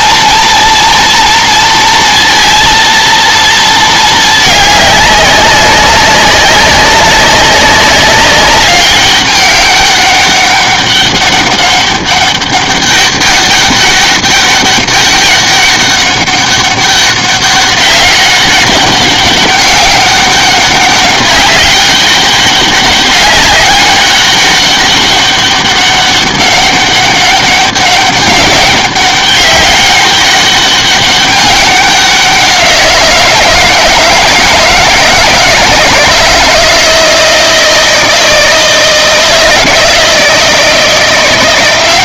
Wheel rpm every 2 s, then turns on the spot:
230, 230, 210, 190, 190, 200, 200, 200, 200, 200, 200, 200, 200, 200, 200, 200, 180, 160, 160, 160, 160.
none